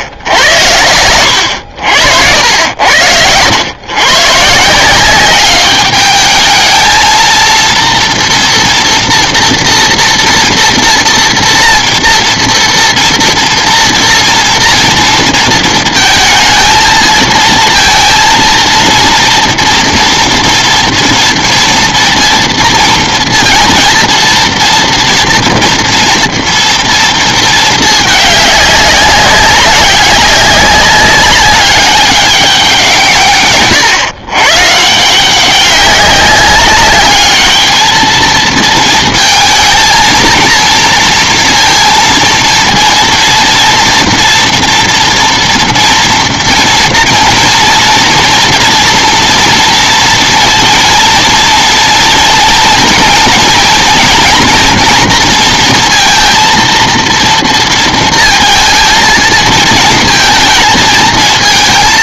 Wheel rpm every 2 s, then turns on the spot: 80, 120, 200, 230, 240, 230, 230, 230, 230, 240, 230, 230, 230, 210, 200, 200, 130, 190, 220, 230, 230, 230, 240, 230, 230, 230, 230, 230, 230, 230, 220.
none